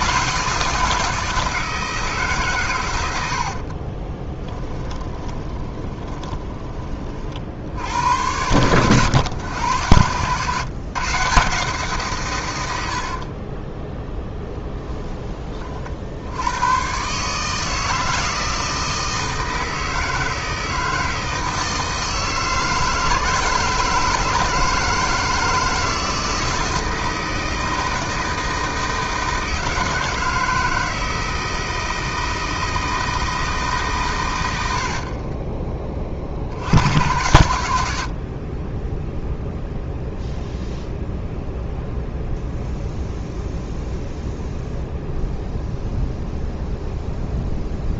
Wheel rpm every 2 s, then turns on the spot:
160, 110, 10, 30, 100, 130, 80, 10, 120, 160, 160, 160, 160, 160, 160, 160, 160, 60, 90, 10, 0, 0, 0, 0.
4-6